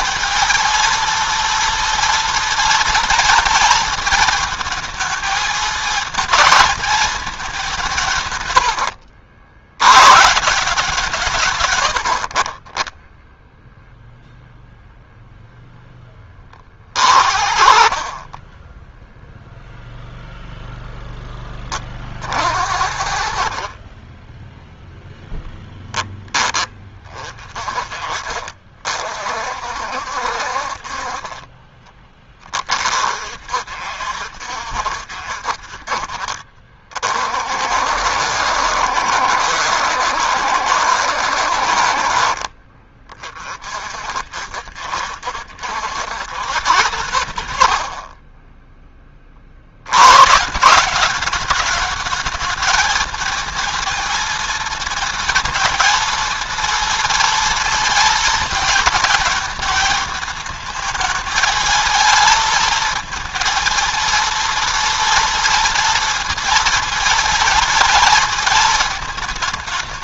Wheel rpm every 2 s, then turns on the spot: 230, 240, 220, 220, 70, 160, 20, 0, 40, 10, 0, 50, 0, 30, 40, 40, 40, 60, 40, 70, 70, 50, 70, 110, 20, 190, 220, 230, 230, 220, 220, 230, 230, 230, 220.
8-10